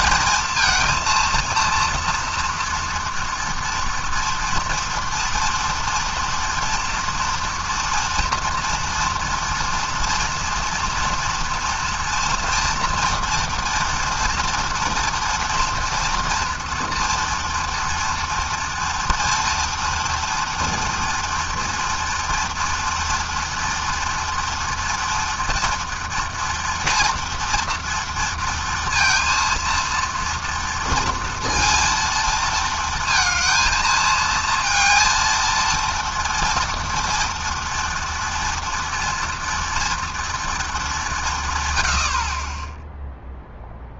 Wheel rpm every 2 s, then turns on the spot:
230, 240, 230, 230, 230, 230, 230, 230, 230, 230, 230, 230, 230, 230, 230, 230, 230, 230, 230, 230, 150, 0.
none